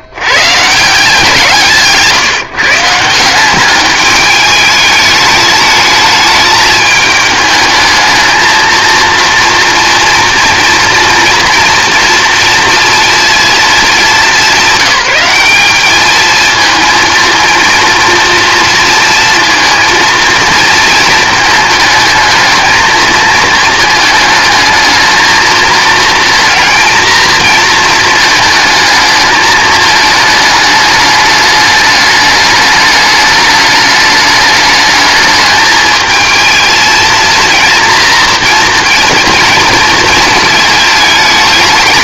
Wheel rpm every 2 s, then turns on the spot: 150, 160, 210, 210, 230, 230, 230, 190, 230, 230, 230, 220, 220, 230, 220, 210, 210, 210, 220, 230, 220.
none